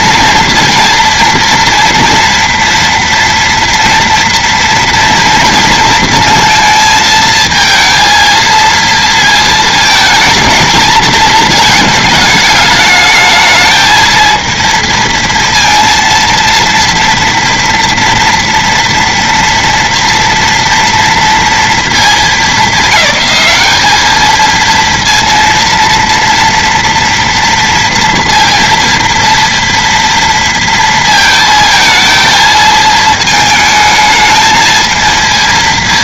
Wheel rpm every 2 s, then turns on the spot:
230, 230, 230, 220, 230, 230, 210, 230, 230, 230, 230, 200, 220, 230, 230, 230, 220, 220.
none